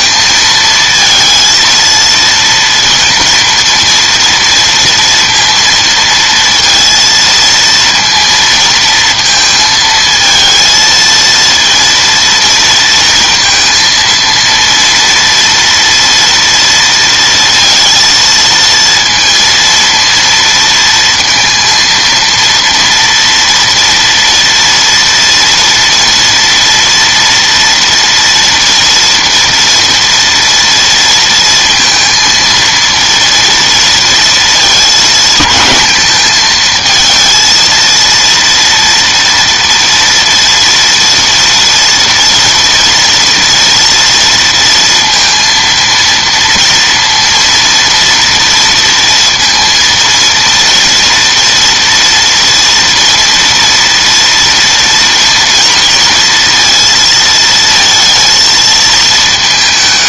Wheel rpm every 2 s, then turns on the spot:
230, 230, 230, 230, 230, 230, 230, 230, 230, 230, 230, 230, 230, 230, 230, 230, 230, 220, 220, 230, 230, 240, 230, 230, 230, 230, 230, 230, 230, 220.
none